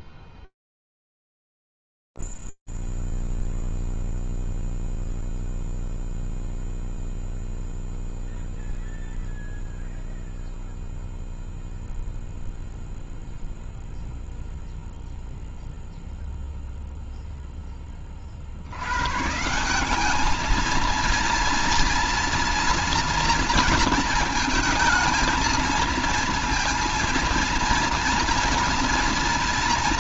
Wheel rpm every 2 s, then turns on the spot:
0, 0, 0, 0, 0, 0, 0, 0, 0, 80, 220, 240, 220, 230, 230.
none